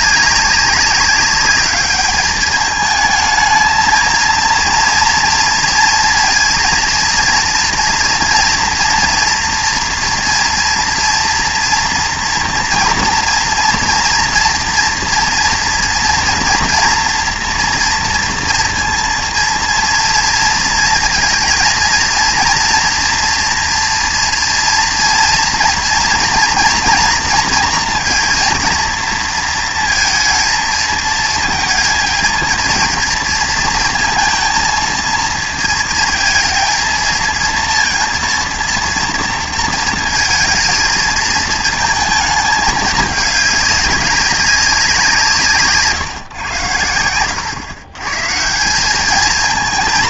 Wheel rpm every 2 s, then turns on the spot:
200, 210, 230, 230, 240, 230, 230, 230, 240, 230, 220, 240, 230, 230, 230, 220, 230, 220, 230, 230, 230, 210, 190, 100, 180.
none